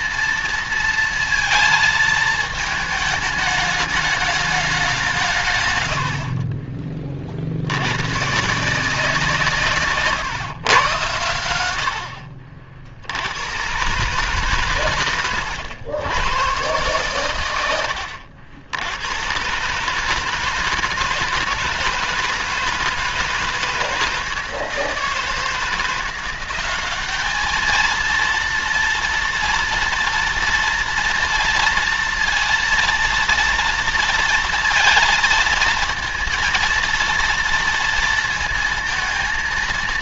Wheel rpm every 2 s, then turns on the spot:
230, 220, 210, 60, 130, 150, 70, 140, 120, 100, 160, 160, 160, 180, 230, 230, 230, 230, 230, 230.
none